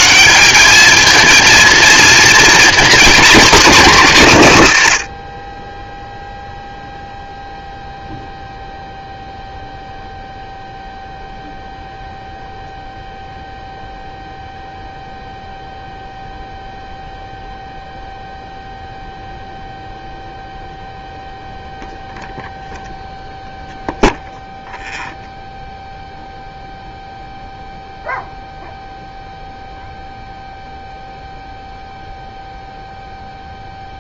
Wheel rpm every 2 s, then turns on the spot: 200, 240, 150, 0, 0, 0, 0, 0, 0, 0, 0, 0, 0, 0, 0, 0, 0.
none